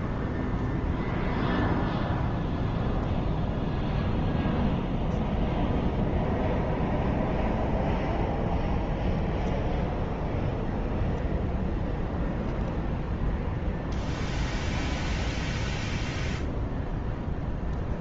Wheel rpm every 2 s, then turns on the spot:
0, 0, 0, 0, 0, 0, 0, 0, 0.
none